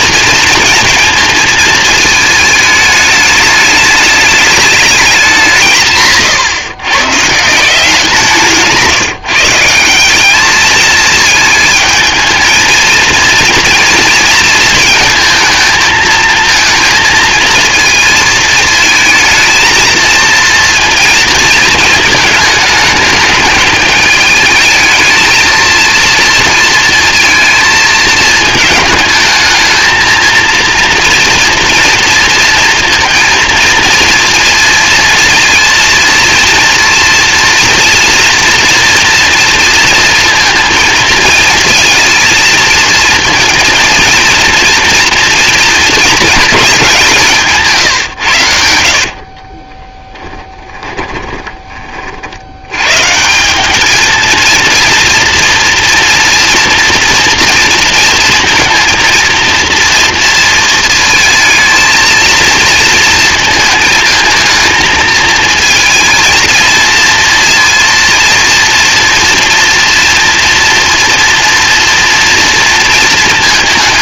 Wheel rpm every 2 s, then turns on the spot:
230, 220, 200, 110, 160, 220, 220, 230, 220, 220, 230, 220, 220, 230, 220, 230, 230, 230, 230, 230, 230, 230, 230, 200, 70, 20, 110, 230, 230, 230, 230, 230, 220, 230, 230, 230, 230.
48-52